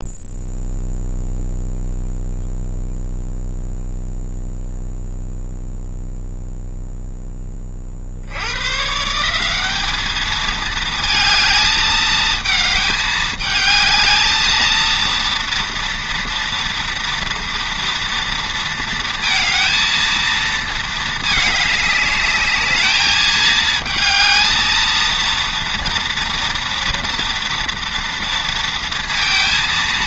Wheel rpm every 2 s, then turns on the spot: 0, 0, 0, 0, 110, 220, 220, 220, 240, 230, 230, 210, 220, 230, 230.
none